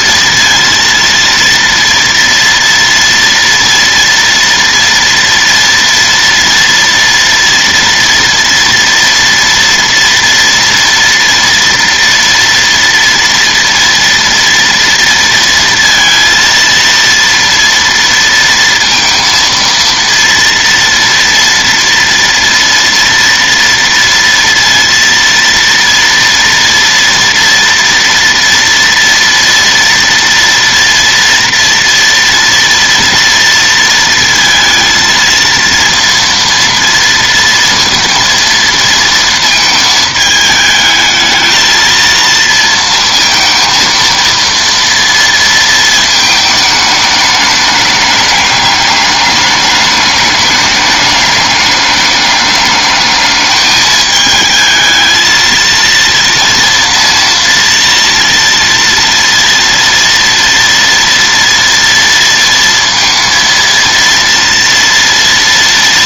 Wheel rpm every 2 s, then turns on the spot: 230, 230, 230, 230, 240, 240, 230, 230, 230, 230, 230, 230, 230, 230, 230, 230, 230, 230, 230, 230, 220, 230, 230, 210, 210, 210, 210, 220, 230, 230, 230, 230, 230.
none